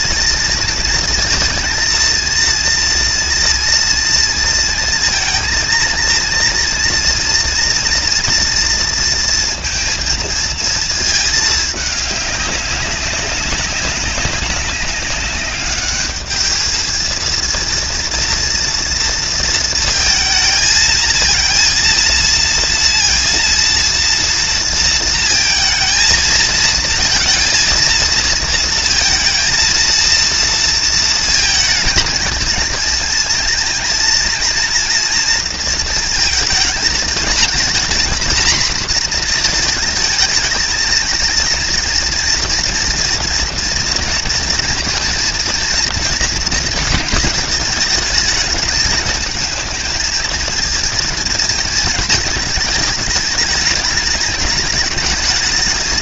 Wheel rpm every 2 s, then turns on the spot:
230, 230, 230, 230, 230, 230, 200, 200, 210, 230, 230, 230, 230, 230, 230, 230, 220, 230, 220, 240, 220, 230, 230, 230, 210, 230, 220, 220.
none